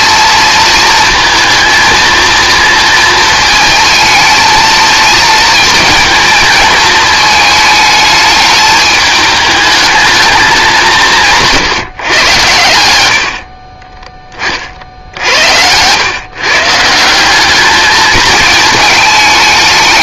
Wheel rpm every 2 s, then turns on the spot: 230, 230, 220, 220, 210, 170, 70, 80, 170, 200.
none